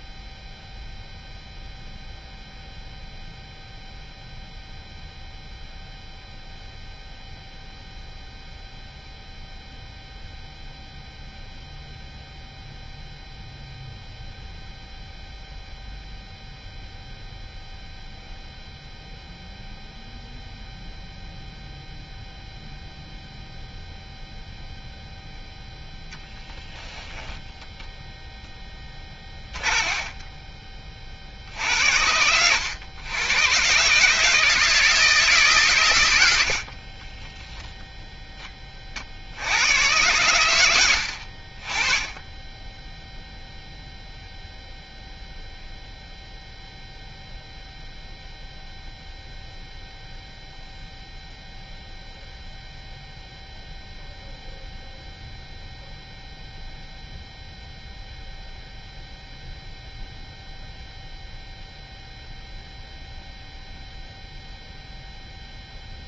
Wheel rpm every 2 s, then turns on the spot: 0, 0, 0, 0, 0, 0, 0, 0, 0, 0, 0, 0, 0, 0, 10, 20, 90, 160, 60, 20, 90, 10, 0, 0, 0, 0, 0, 0, 0, 0, 0, 0, 0.
28-30 36-38 42-44